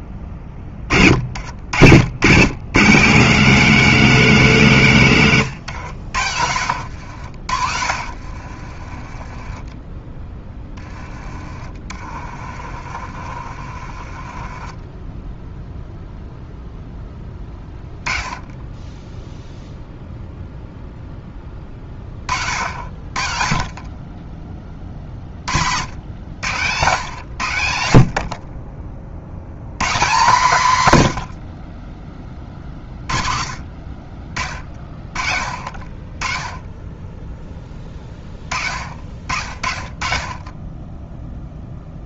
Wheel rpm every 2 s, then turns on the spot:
40, 150, 160, 80, 40, 20, 40, 20, 10, 10, 0, 60, 30, 120, 40, 140, 50, 50, 20, 40, 20.
6-10 12-16